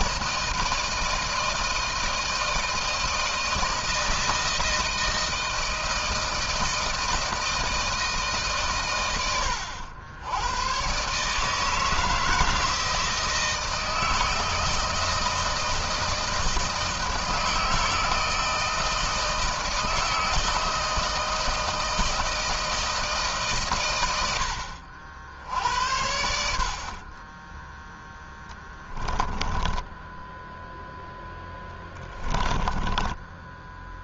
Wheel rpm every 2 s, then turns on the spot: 160, 160, 160, 160, 120, 120, 160, 160, 160, 160, 160, 160, 70, 60, 10, 0, 20.
32-34